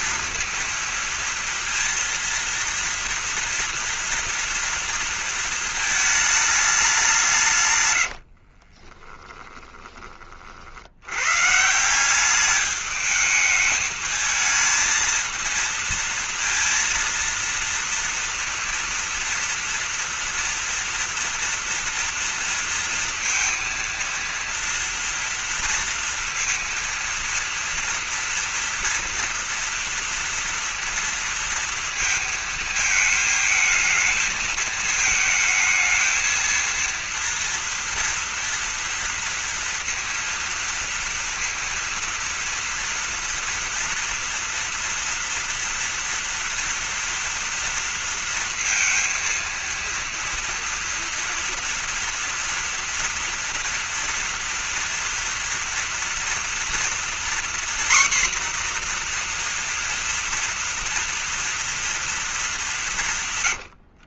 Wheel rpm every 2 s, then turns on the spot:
230, 230, 230, 210, 50, 50, 210, 220, 230, 230, 230, 230, 230, 230, 240, 230, 220, 220, 230, 240, 230, 230, 230, 230, 230, 230, 230, 230, 230, 250, 230, 200.
8-10